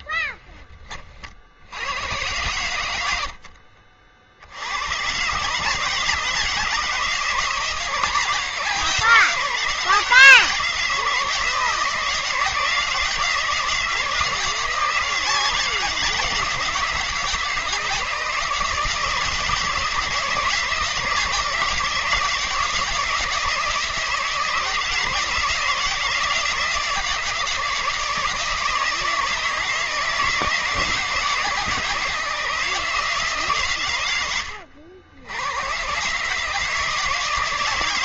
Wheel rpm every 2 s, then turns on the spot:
20, 90, 90, 160, 160, 160, 170, 170, 160, 160, 160, 170, 160, 170, 160, 160, 160, 90, 160.
none